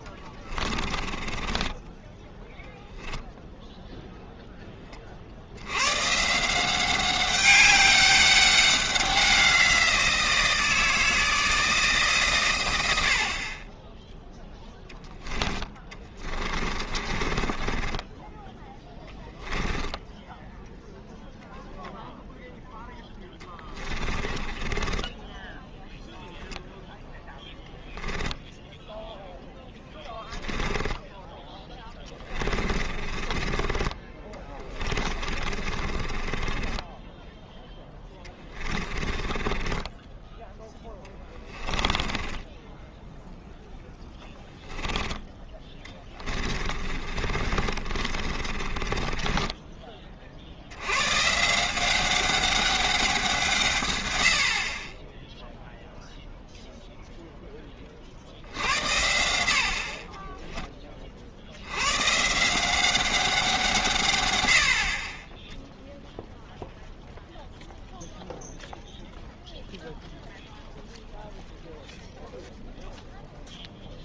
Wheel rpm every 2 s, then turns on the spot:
30, 10, 20, 180, 190, 160, 130, 0, 30, 10, 0, 0, 20, 0, 0, 10, 30, 30, 20, 20, 10, 10, 10, 30, 30, 80, 200, 50, 0, 80, 20, 180, 70, 0, 0, 0, 0.
0-2 16-20 24-26 30-40 42-44 46-50